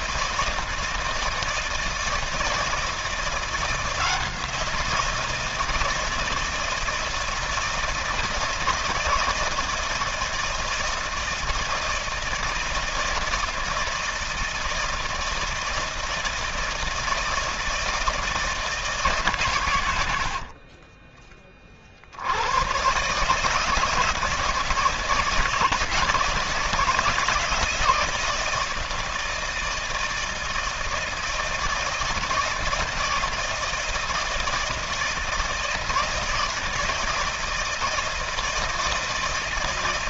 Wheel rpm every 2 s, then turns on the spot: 170, 170, 170, 160, 160, 160, 160, 160, 160, 150, 40, 130, 160, 160, 160, 160, 160, 160, 160, 160.
none